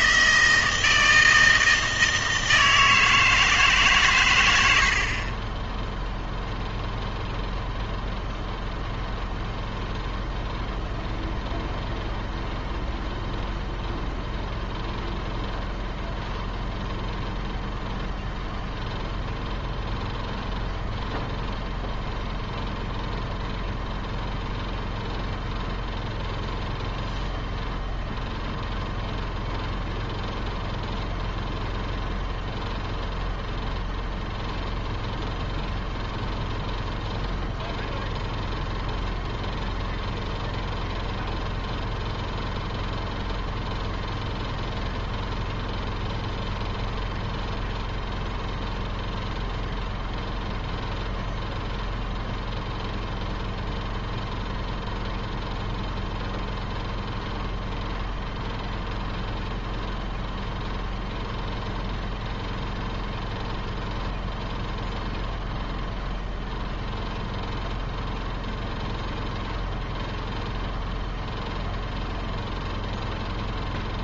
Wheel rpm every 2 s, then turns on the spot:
160, 160, 80, 0, 0, 0, 0, 0, 0, 0, 0, 0, 0, 0, 0, 0, 0, 0, 0, 0, 0, 0, 0, 0, 0, 0, 0, 0, 0, 0, 0, 0, 0, 0, 0, 0, 0.
none